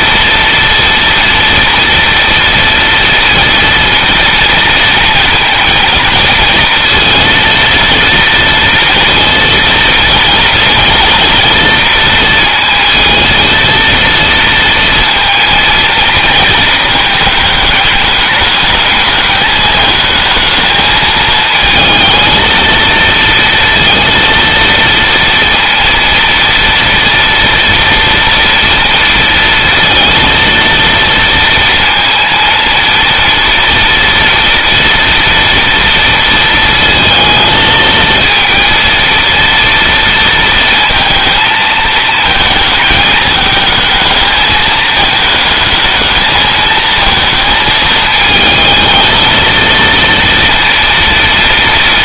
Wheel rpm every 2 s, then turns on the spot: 230, 240, 230, 230, 230, 230, 230, 230, 220, 220, 220, 230, 230, 240, 230, 230, 230, 240, 230, 230, 230, 220, 220, 220, 220, 230.
none